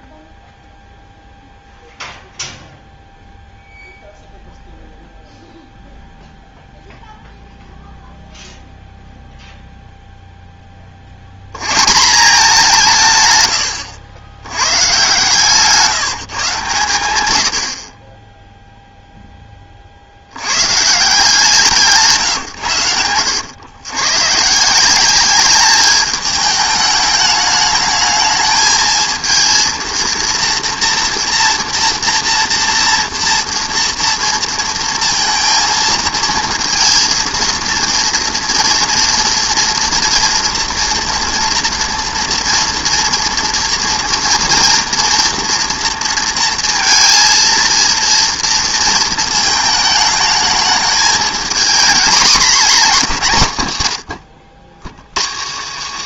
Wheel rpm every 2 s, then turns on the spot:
0, 0, 0, 0, 0, 70, 130, 140, 100, 0, 160, 100, 190, 210, 220, 230, 240, 230, 230, 230, 230, 230, 230, 230, 220, 220, 180, 130.
none